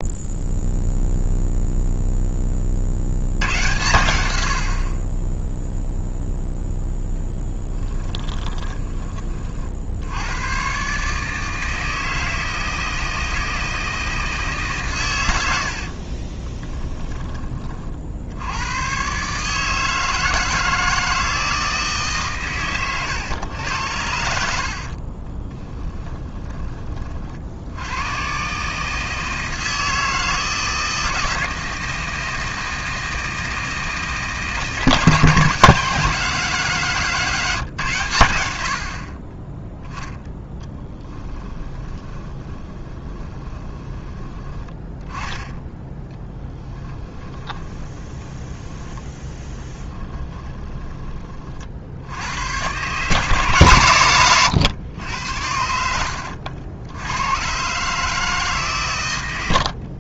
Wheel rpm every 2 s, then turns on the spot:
0, 50, 60, 0, 20, 130, 160, 130, 20, 110, 160, 120, 50, 30, 150, 160, 160, 160, 170, 70, 10, 20, 10, 10, 10, 20, 120, 100, 90, 130.
8-10 16-18 24-26 40-44 46-48